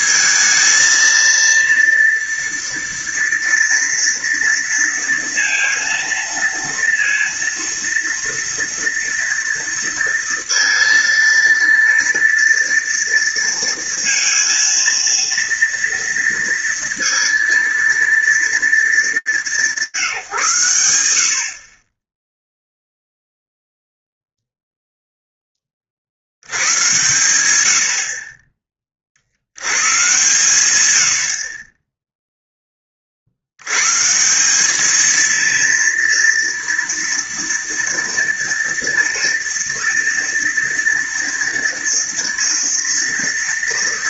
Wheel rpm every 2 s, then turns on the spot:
220, 230, 230, 230, 230, 230, 230, 230, 230, 220, 130, 0, 0, 100, 40, 110, 30, 210, 230, 230, 230, 230.
none